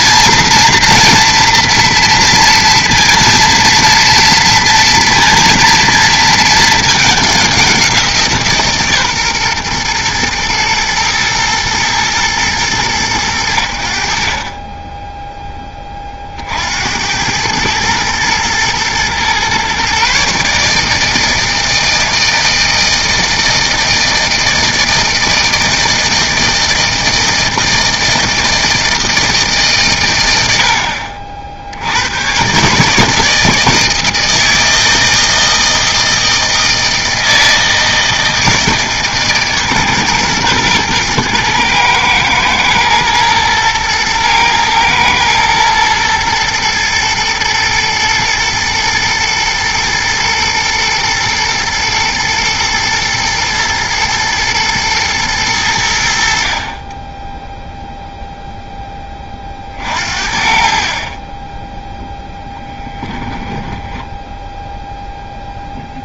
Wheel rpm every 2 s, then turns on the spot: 240, 230, 230, 220, 150, 120, 110, 20, 70, 120, 150, 160, 160, 160, 160, 80, 140, 160, 160, 160, 120, 110, 110, 120, 110, 110, 110, 120, 40, 0, 40, 10, 0.
62-64